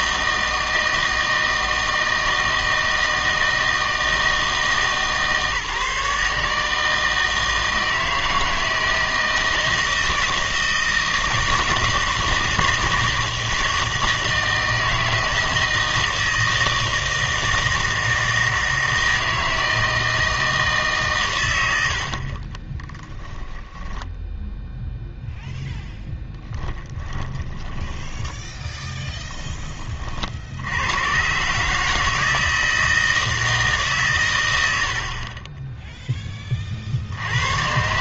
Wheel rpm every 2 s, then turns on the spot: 160, 160, 160, 160, 160, 160, 160, 160, 160, 160, 160, 20, 0, 10, 10, 80, 160, 80, 50.
22-24 26-28